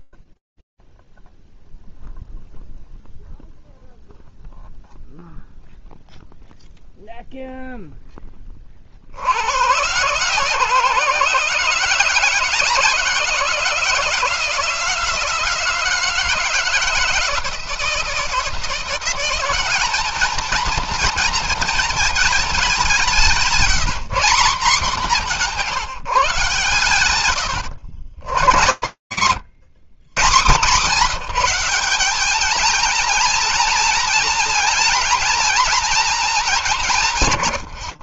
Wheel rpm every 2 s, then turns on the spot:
0, 0, 0, 10, 150, 170, 170, 160, 160, 210, 210, 200, 150, 130, 120, 200, 220, 210, 60.
none